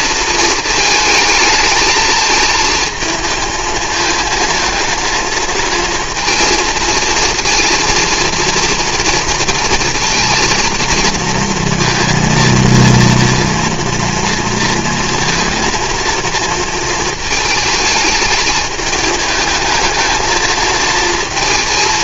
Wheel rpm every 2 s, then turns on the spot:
220, 220, 230, 230, 230, 230, 230, 230, 230, 210, 220.
none